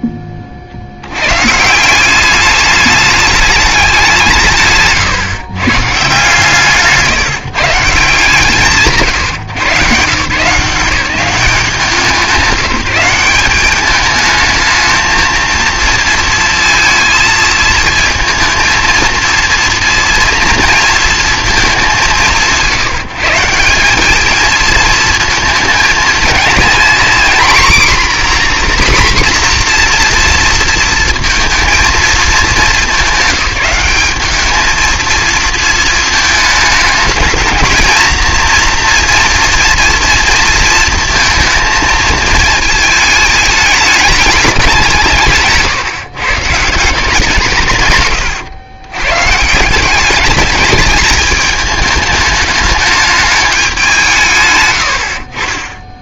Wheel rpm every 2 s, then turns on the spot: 40, 200, 150, 160, 130, 170, 190, 220, 230, 230, 230, 170, 220, 230, 250, 240, 210, 220, 220, 230, 230, 220, 190, 160, 110, 200, 210, 120.
54-56